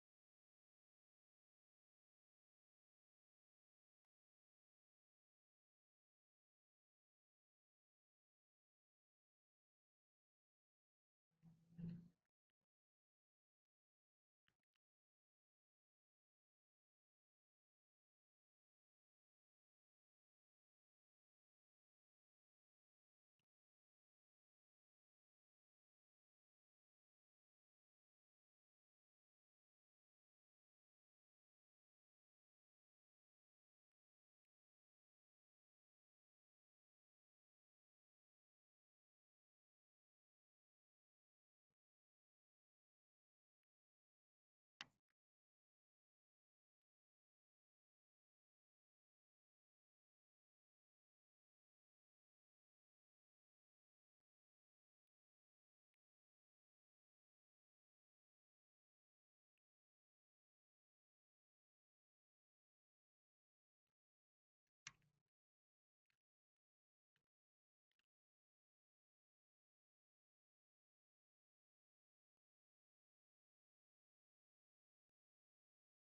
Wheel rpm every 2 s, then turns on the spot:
0, 0, 0, 0, 0, 0, 0, 0, 0, 0, 0, 0, 0, 0, 0, 0, 0, 0, 0, 0, 0, 0, 0, 0, 0, 0, 0, 0, 0, 0, 0, 0, 0, 0, 0, 0, 0, 0.
none